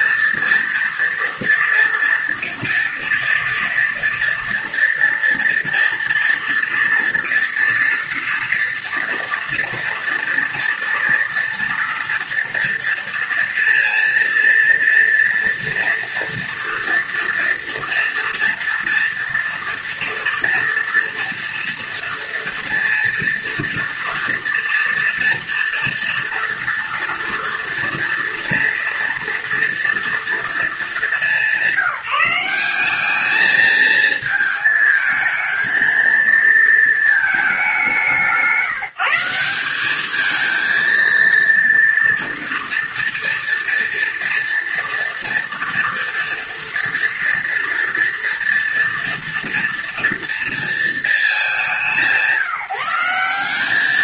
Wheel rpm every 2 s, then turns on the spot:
230, 230, 230, 230, 230, 230, 230, 230, 230, 230, 230, 230, 230, 230, 230, 210, 200, 220, 220, 170, 230, 230, 230, 230, 230, 230, 180.
none